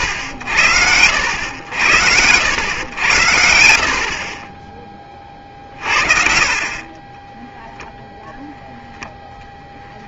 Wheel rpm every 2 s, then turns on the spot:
80, 100, 20, 60, 0.
none